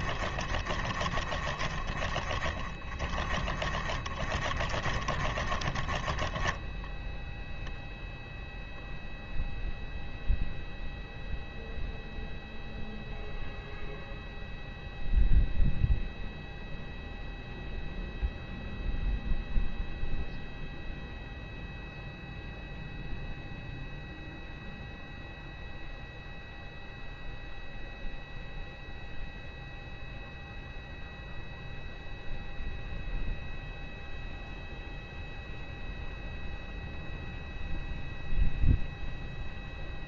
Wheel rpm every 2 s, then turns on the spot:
20, 20, 20, 10, 0, 0, 0, 0, 0, 0, 0, 0, 0, 0, 0, 0, 0, 0, 0, 0.
0-8